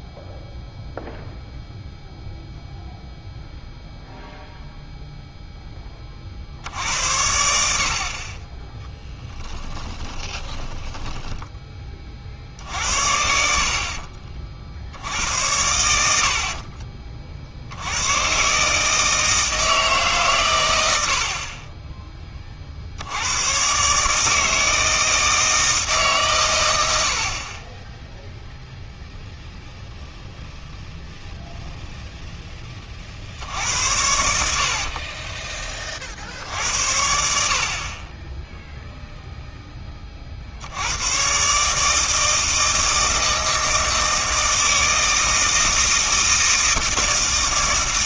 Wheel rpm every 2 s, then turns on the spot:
0, 0, 0, 70, 10, 20, 60, 60, 40, 150, 100, 50, 160, 100, 0, 0, 20, 60, 70, 0, 80, 160, 160, 160.
10-12